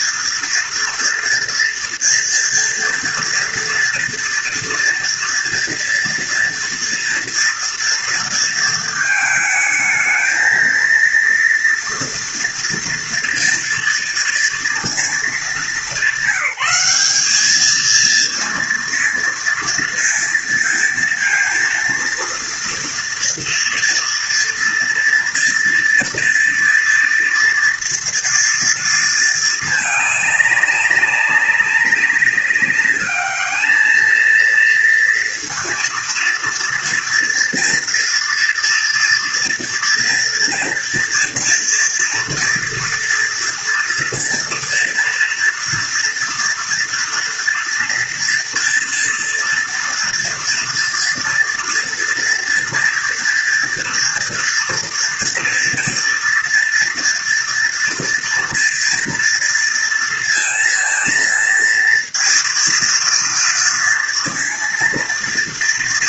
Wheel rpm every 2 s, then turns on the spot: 230, 230, 230, 240, 220, 230, 230, 220, 200, 230, 230, 230, 230, 230, 230, 200, 210, 230, 230, 240, 230, 230, 230, 230, 230, 230, 230, 230, 240, 230, 230, 230, 230.
none